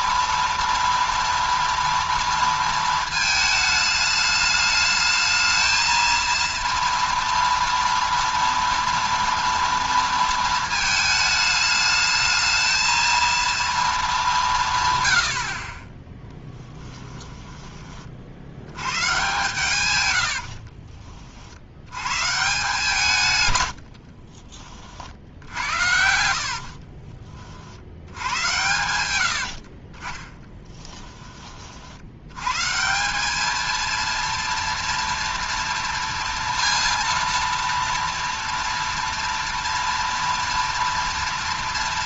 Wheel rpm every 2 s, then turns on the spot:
230, 230, 220, 230, 230, 220, 220, 160, 10, 90, 70, 160, 50, 70, 100, 10, 140, 230, 230, 230, 230.
16-18 20-22 26-28 30-32